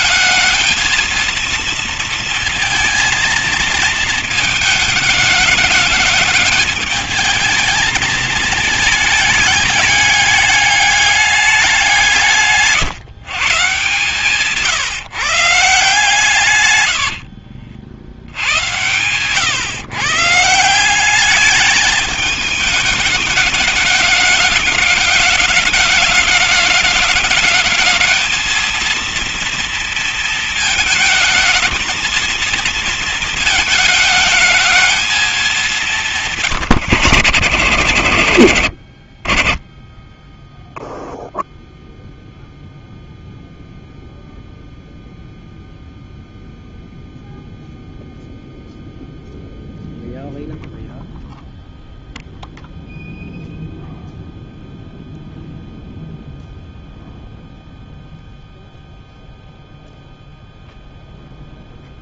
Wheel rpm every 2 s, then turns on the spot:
230, 230, 210, 210, 210, 210, 150, 130, 100, 110, 180, 210, 210, 210, 230, 230, 220, 220, 140, 60, 0, 0, 0, 0, 0, 0, 0, 0, 0, 0, 0.
16-18